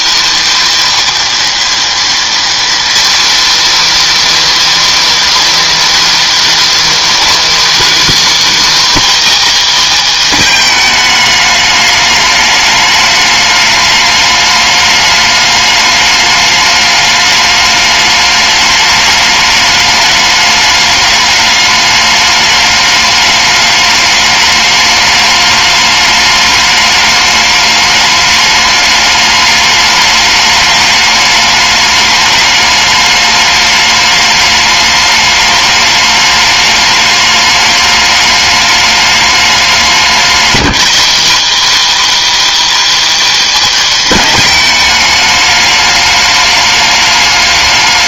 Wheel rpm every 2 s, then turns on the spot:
290, 240, 310, 310, 300, 240, 210, 210, 210, 210, 210, 210, 210, 210, 210, 210, 210, 210, 210, 210, 220, 310, 220, 210.
none